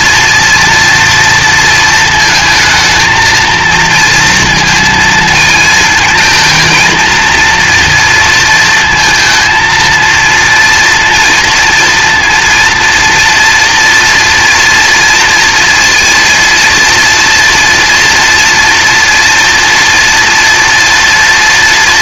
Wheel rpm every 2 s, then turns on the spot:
240, 220, 230, 230, 230, 230, 230, 230, 240, 230, 230.
none